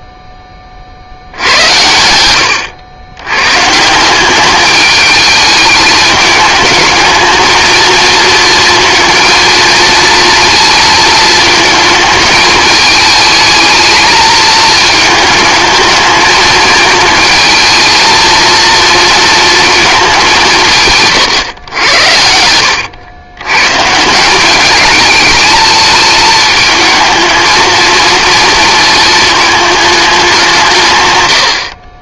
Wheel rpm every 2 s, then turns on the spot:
40, 100, 210, 220, 230, 230, 220, 220, 220, 230, 150, 90, 210, 220, 220, 140.
none